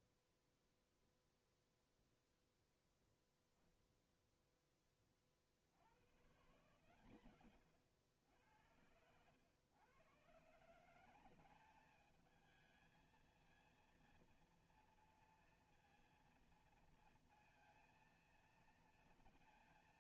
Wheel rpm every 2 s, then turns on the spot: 0, 0, 0, 120, 90, 130, 220, 230, 230, 230.
none